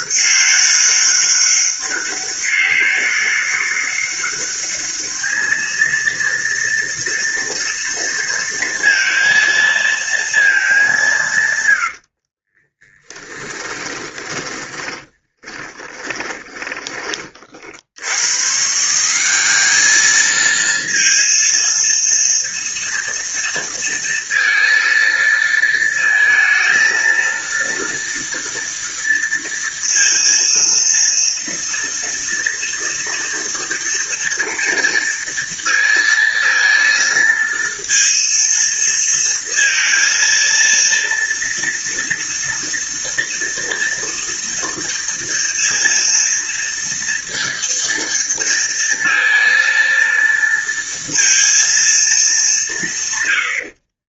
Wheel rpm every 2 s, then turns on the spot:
200, 200, 200, 230, 230, 220, 50, 10, 20, 110, 220, 230, 230, 230, 230, 230, 230, 230, 230, 230, 230, 230, 230, 230, 230, 230, 210.
12-18